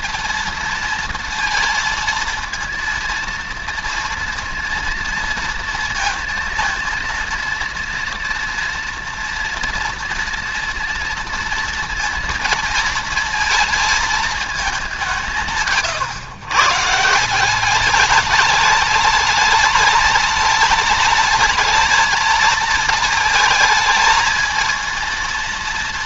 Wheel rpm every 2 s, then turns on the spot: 230, 230, 230, 230, 230, 230, 230, 210, 130, 210, 220, 220, 220.
none